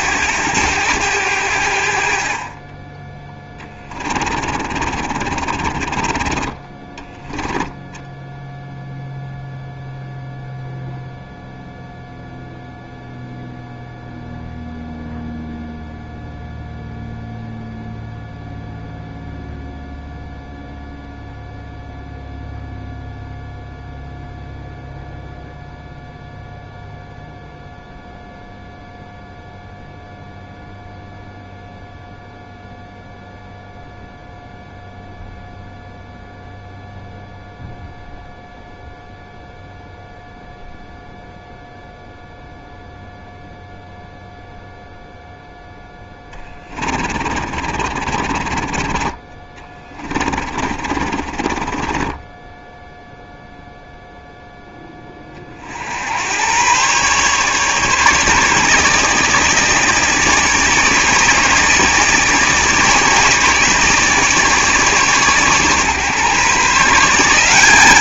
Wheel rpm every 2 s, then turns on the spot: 90, 20, 40, 20, 0, 0, 0, 0, 0, 0, 0, 0, 0, 0, 0, 0, 0, 0, 0, 0, 0, 0, 0, 20, 40, 40, 10, 0, 120, 150, 150, 150, 150, 150.
4-6 46-54